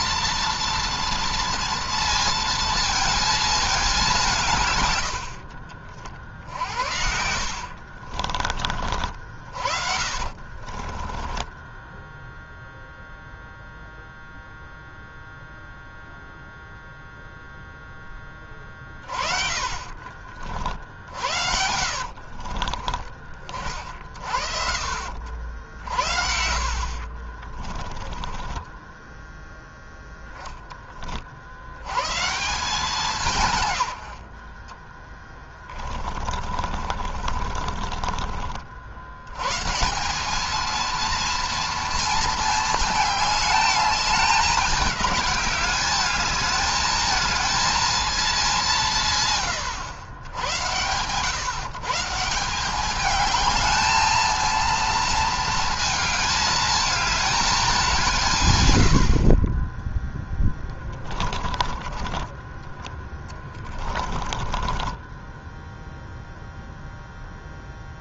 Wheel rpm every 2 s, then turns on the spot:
230, 230, 120, 70, 60, 30, 0, 0, 0, 30, 50, 40, 70, 50, 10, 20, 170, 20, 40, 70, 230, 220, 200, 220, 170, 110, 200, 230, 220, 80, 20, 20, 20, 0.
10-12 18-22 26-30 34-38 60-62 64-66